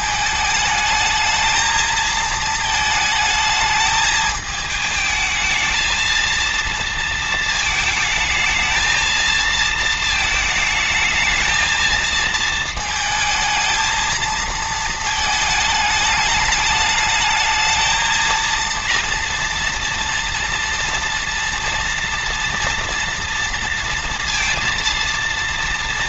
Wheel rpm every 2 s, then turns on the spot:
210, 220, 220, 230, 220, 220, 220, 220, 210, 230, 230, 230, 230.
none